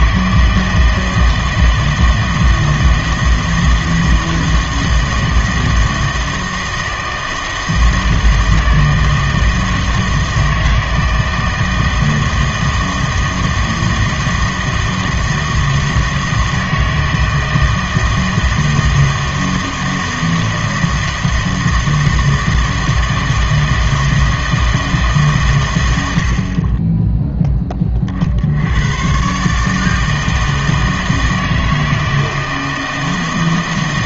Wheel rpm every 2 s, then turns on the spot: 160, 160, 160, 160, 160, 160, 160, 160, 160, 160, 160, 160, 160, 30, 90, 160, 160.
none